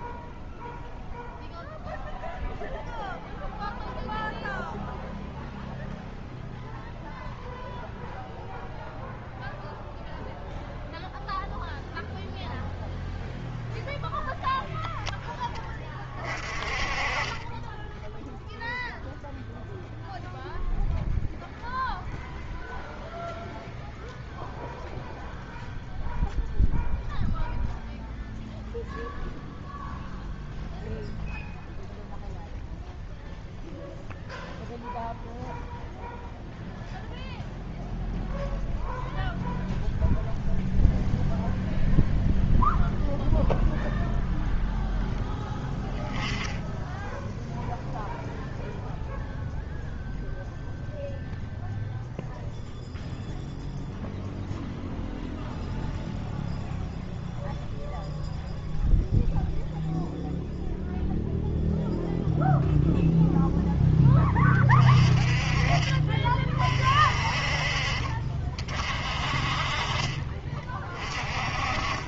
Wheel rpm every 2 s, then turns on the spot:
0, 0, 0, 0, 0, 0, 0, 0, 30, 0, 0, 0, 0, 0, 0, 0, 0, 0, 0, 0, 0, 0, 0, 10, 0, 0, 0, 0, 0, 0, 0, 0, 20, 40, 50, 30.
16-18